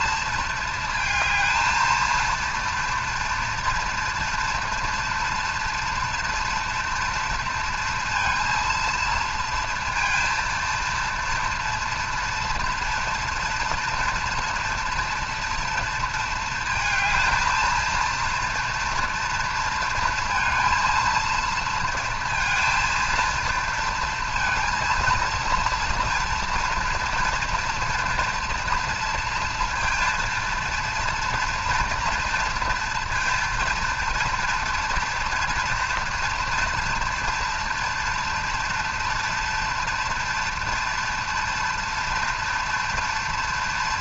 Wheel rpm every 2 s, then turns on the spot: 220, 230, 230, 240, 230, 230, 230, 240, 220, 230, 230, 230, 230, 230, 230, 230, 230, 240, 240, 230, 230, 230.
none